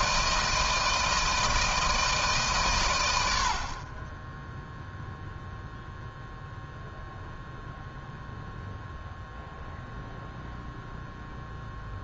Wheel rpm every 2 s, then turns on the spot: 160, 150, 10, 0, 0, 0.
none